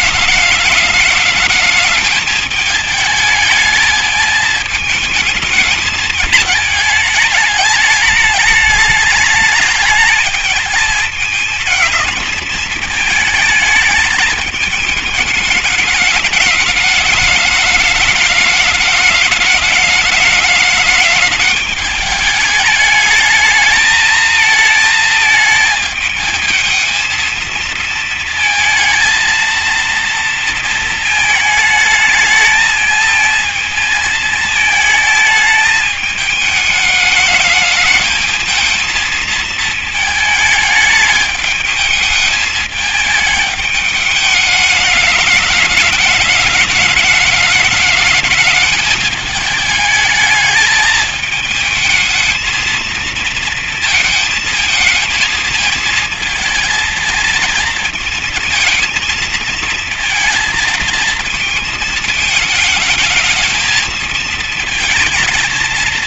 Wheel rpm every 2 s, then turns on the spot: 210, 220, 220, 220, 210, 220, 220, 210, 210, 210, 210, 210, 230, 220, 220, 230, 220, 220, 210, 220, 220, 210, 210, 210, 210, 220, 220, 220, 220, 220, 220, 210, 220.
none